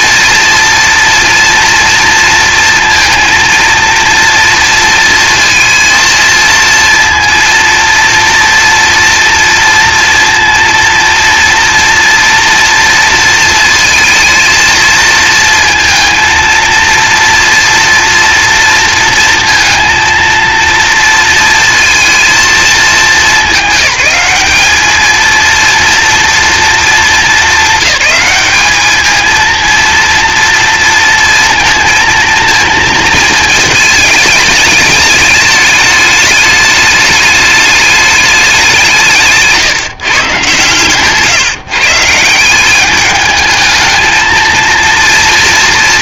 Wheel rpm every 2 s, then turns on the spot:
230, 230, 230, 230, 230, 230, 230, 230, 230, 230, 230, 220, 210, 230, 210, 230, 230, 210, 210, 180, 130, 190, 230.
none